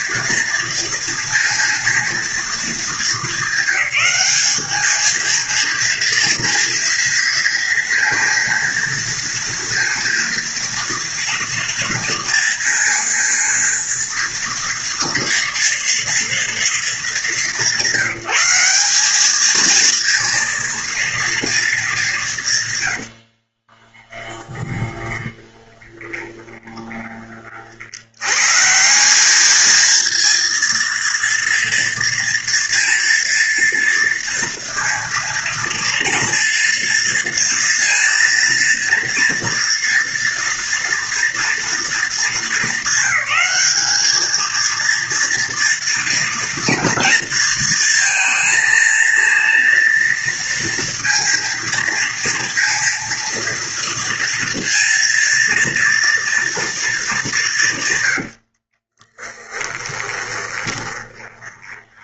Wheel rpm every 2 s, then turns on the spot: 230, 230, 210, 230, 230, 230, 230, 230, 230, 190, 230, 120, 20, 20, 160, 230, 230, 230, 230, 230, 230, 200, 230, 230, 230, 230, 230, 230, 220, 50, 20.
24-28 58-62